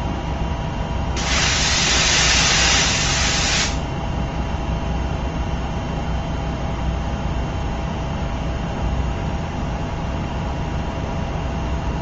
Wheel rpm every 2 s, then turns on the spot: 0, 0, 0, 0, 0, 0.
none